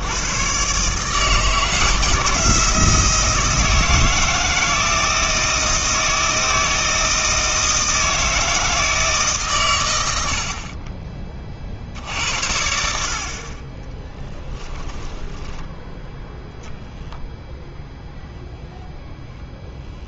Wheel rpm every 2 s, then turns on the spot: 130, 170, 160, 160, 160, 40, 70, 10, 0, 0.
14-16